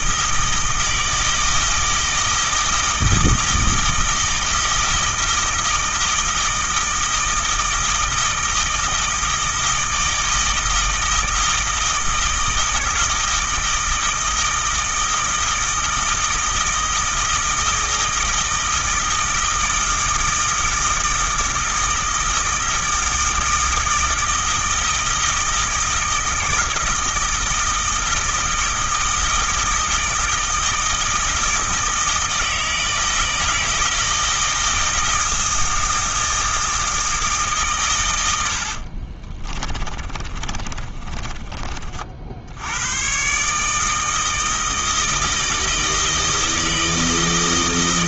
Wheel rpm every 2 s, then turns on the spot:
160, 160, 160, 160, 160, 160, 160, 160, 160, 160, 160, 160, 160, 160, 160, 160, 160, 160, 160, 60, 30, 100, 160, 160.
38-42